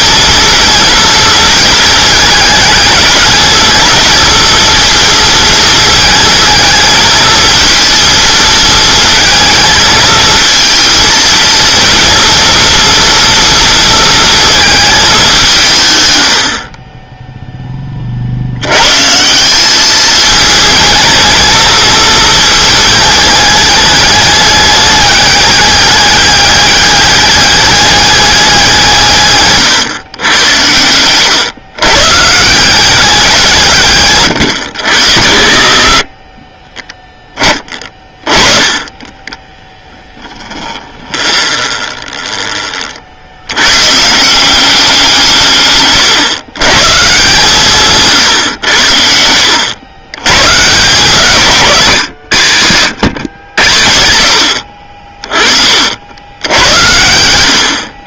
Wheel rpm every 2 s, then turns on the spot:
230, 210, 220, 220, 220, 220, 230, 220, 30, 100, 220, 220, 210, 200, 180, 100, 170, 90, 20, 20, 20, 30, 190, 130, 100, 130, 110, 70, 80.
40-42